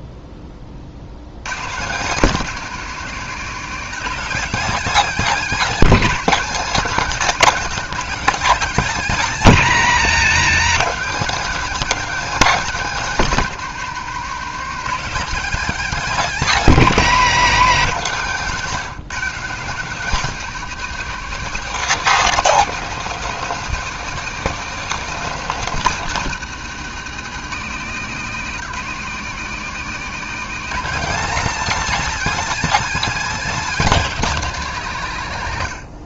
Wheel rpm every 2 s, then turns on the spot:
60, 210, 240, 220, 210, 210, 230, 220, 220, 170, 240, 250, 240, 220, 200, 230, 250, 190.
none